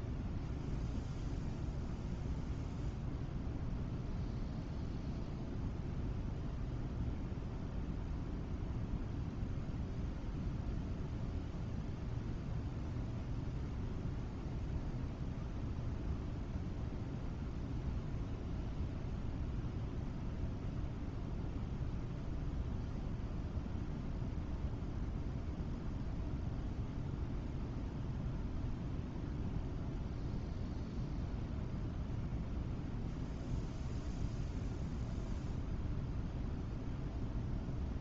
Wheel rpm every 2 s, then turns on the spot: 0, 0, 0, 0, 0, 0, 0, 0, 0, 0, 0, 0, 0, 0, 0, 0, 0, 0, 0.
none